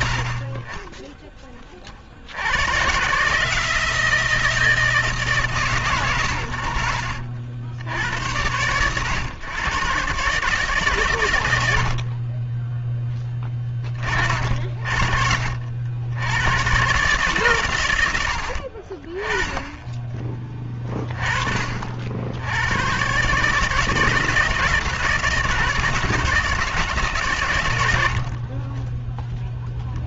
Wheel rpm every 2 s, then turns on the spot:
40, 110, 160, 90, 110, 140, 10, 50, 130, 30, 20, 120, 160, 150, 10.
none